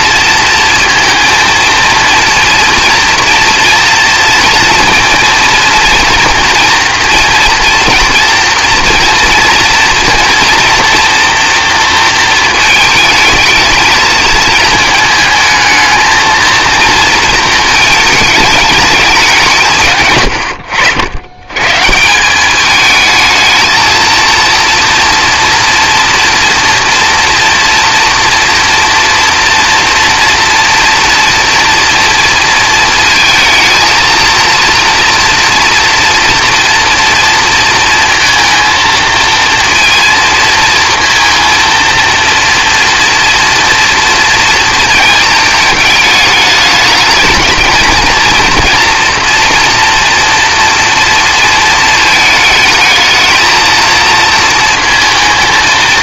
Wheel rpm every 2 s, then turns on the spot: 230, 230, 230, 230, 230, 240, 220, 220, 230, 210, 100, 210, 230, 230, 230, 230, 220, 230, 230, 230, 230, 230, 230, 210, 230, 230, 220, 230.
none